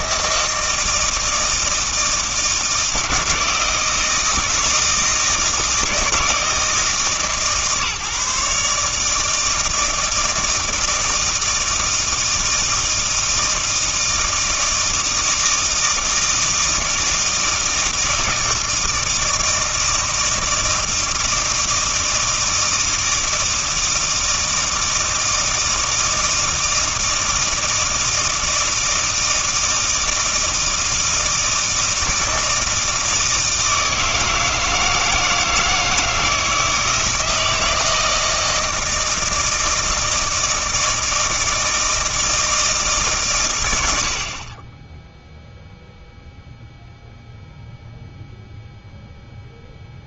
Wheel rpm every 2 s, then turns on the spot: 160, 160, 160, 150, 150, 160, 160, 160, 160, 160, 160, 160, 160, 160, 160, 160, 160, 160, 160, 160, 160, 160, 20, 0, 0.
none